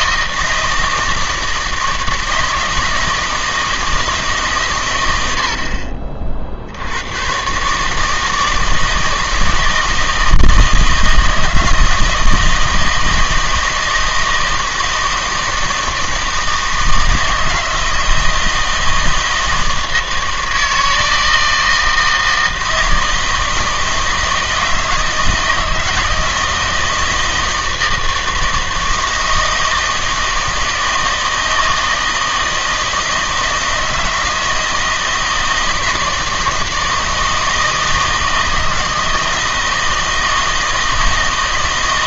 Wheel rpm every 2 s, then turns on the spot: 160, 160, 120, 70, 160, 160, 160, 160, 160, 160, 160, 160, 160, 160, 160, 160, 160, 160, 160, 160, 160.
none